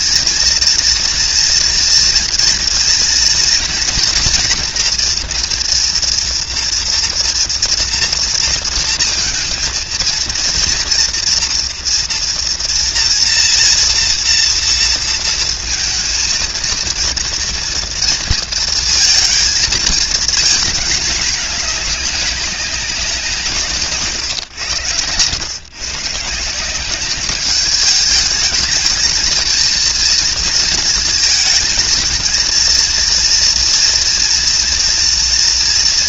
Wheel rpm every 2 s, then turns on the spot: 230, 230, 240, 230, 230, 230, 230, 230, 230, 220, 230, 200, 120, 180, 210, 230, 230, 230.
24-26